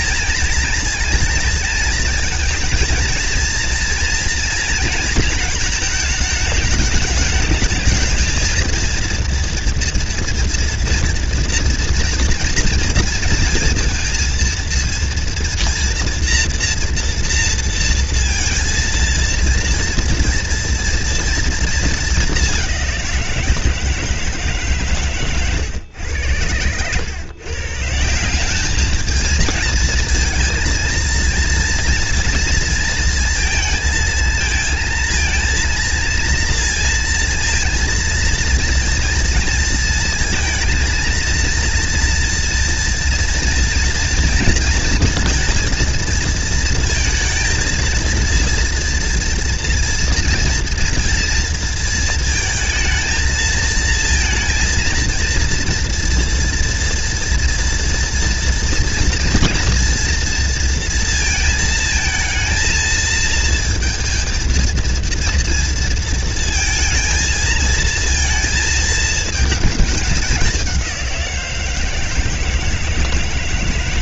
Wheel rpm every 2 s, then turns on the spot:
230, 230, 230, 210, 230, 230, 230, 230, 230, 230, 230, 180, 140, 110, 210, 230, 230, 230, 230, 230, 230, 240, 230, 230, 230, 230, 220, 230, 230, 230, 230, 230, 230, 230, 220, 180, 160.
none